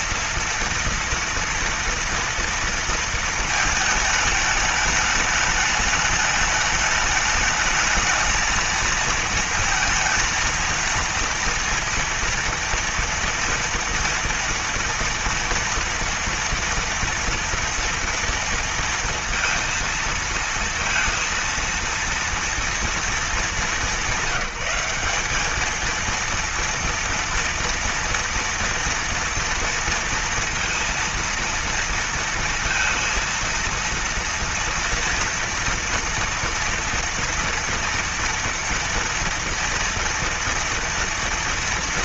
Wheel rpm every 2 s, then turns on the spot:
230, 230, 210, 210, 230, 230, 230, 230, 230, 230, 230, 230, 190, 230, 230, 230, 230, 230, 240, 230, 230.
none